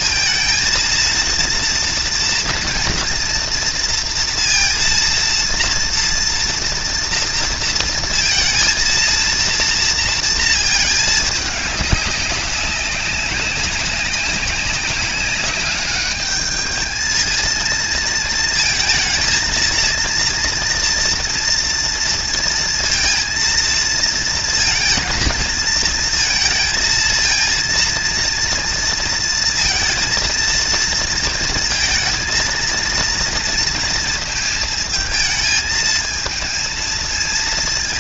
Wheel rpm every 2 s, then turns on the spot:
230, 230, 230, 230, 230, 220, 190, 200, 220, 230, 230, 230, 230, 230, 230, 230, 230, 220, 230.
none